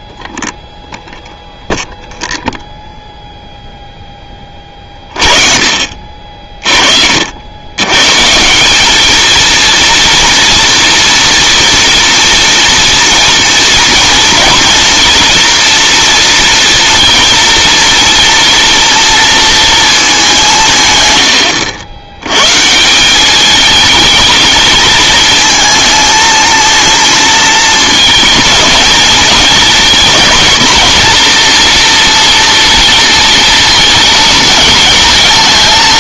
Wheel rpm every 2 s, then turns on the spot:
0, 0, 30, 40, 170, 230, 230, 220, 230, 230, 170, 130, 220, 230, 220, 230, 230, 230.
none